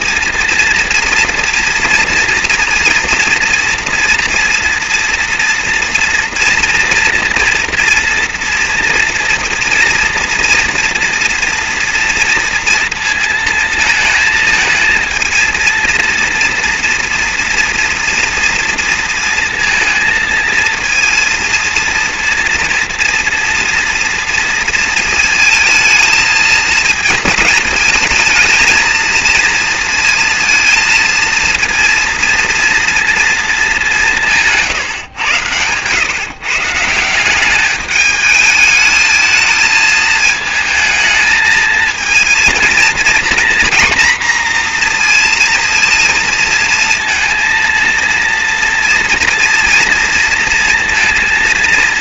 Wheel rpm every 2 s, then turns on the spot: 230, 230, 230, 230, 230, 240, 230, 220, 240, 230, 230, 230, 230, 220, 230, 230, 230, 150, 150, 210, 220, 230, 240, 230, 240, 240.
none